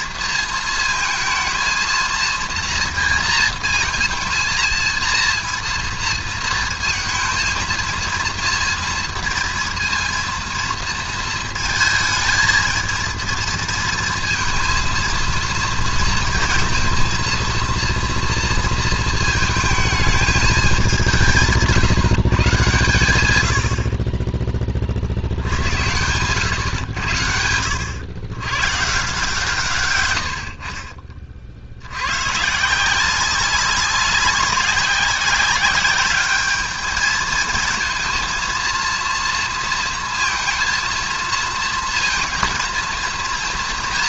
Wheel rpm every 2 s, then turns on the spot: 220, 230, 230, 230, 230, 230, 220, 230, 230, 230, 200, 130, 40, 110, 130, 50, 170, 190, 210, 230, 230, 230.
none